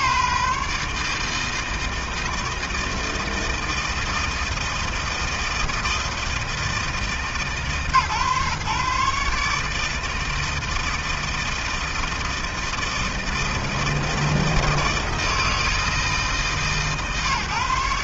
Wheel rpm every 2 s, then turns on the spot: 160, 160, 160, 130, 150, 160, 160, 160, 140.
none